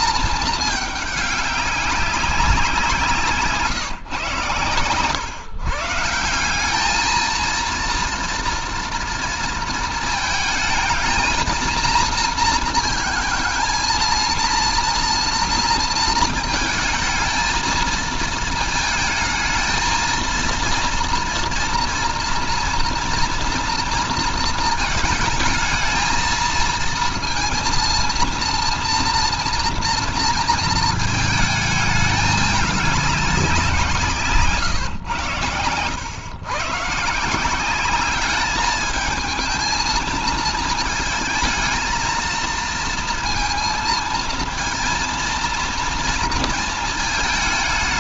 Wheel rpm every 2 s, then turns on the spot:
220, 180, 130, 200, 230, 220, 230, 230, 230, 220, 230, 230, 220, 230, 230, 220, 200, 130, 130, 210, 220, 230, 230, 220.
none